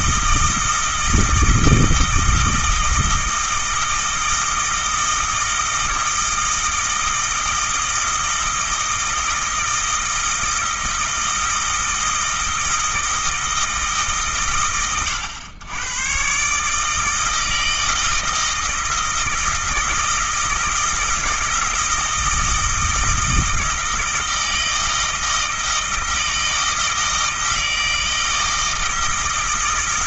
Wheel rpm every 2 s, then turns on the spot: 160, 160, 160, 160, 160, 160, 160, 120, 140, 160, 160, 160, 160, 160, 160.
none